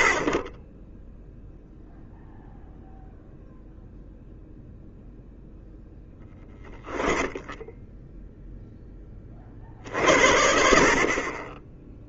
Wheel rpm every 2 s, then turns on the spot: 10, 0, 0, 10, 10, 40.
none